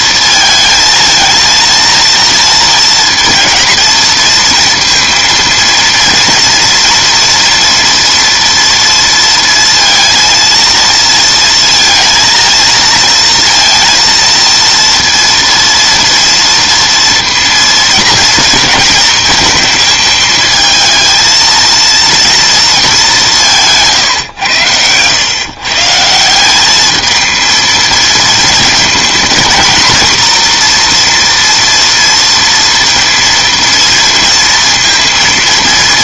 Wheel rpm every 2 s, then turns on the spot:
230, 230, 230, 230, 230, 230, 230, 230, 230, 230, 230, 220, 110, 200, 230, 240, 230, 230.
none